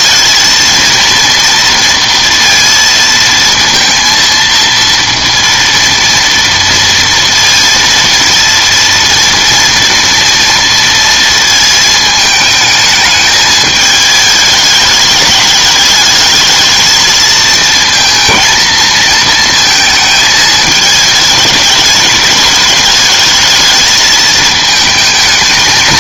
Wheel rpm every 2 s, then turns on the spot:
230, 230, 230, 230, 230, 230, 220, 210, 220, 230, 220, 210, 220.
none